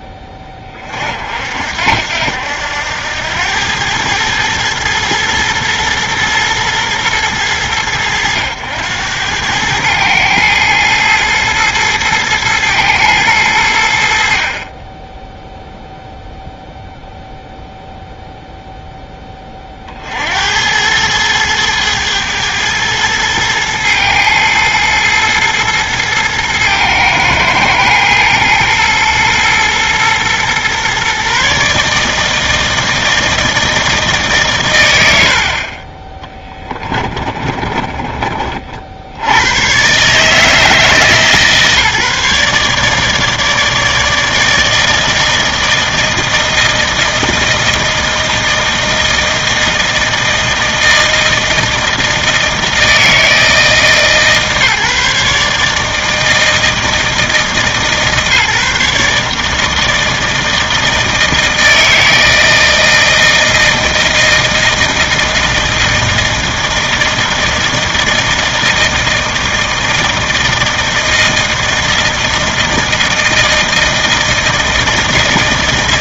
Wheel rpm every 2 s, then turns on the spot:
20, 80, 110, 110, 90, 110, 110, 30, 0, 0, 80, 110, 110, 110, 110, 120, 160, 110, 10, 30, 150, 150, 160, 160, 160, 160, 160, 150, 160, 150, 160, 160, 160, 160, 160, 160, 160, 160.
36-38